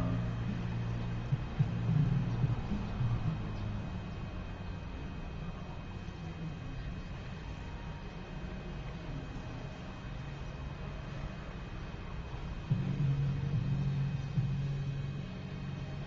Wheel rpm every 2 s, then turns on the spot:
0, 0, 0, 0, 0, 0, 0, 0.
none